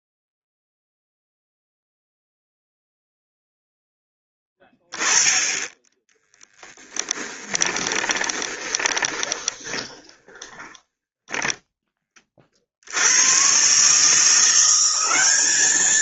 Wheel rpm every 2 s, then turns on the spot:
0, 0, 10, 10, 20, 10, 60, 180.
6-12